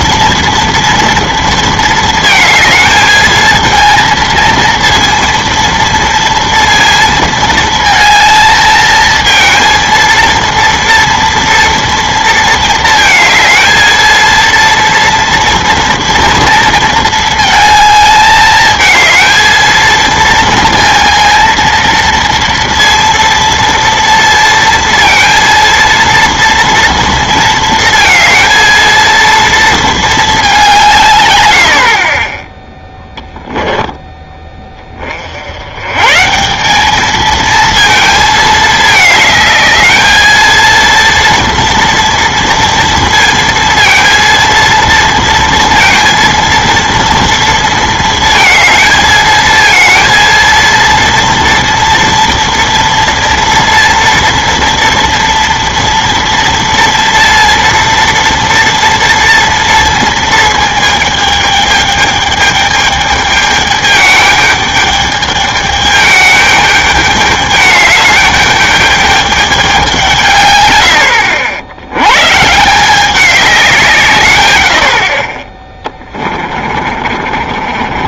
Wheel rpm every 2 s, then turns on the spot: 230, 220, 230, 230, 220, 230, 220, 230, 230, 220, 230, 230, 230, 230, 230, 170, 10, 30, 210, 220, 230, 230, 230, 230, 230, 230, 230, 230, 230, 230, 220, 210, 210, 210, 210, 90, 180, 70, 40.
76-78